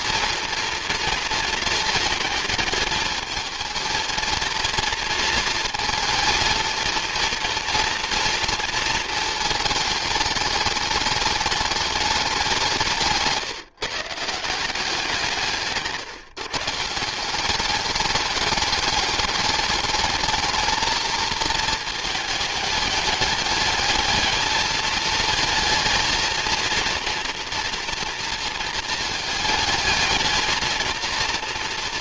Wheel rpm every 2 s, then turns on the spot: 230, 220, 230, 230, 230, 210, 170, 180, 150, 210, 220, 220, 220, 230, 230, 230.
none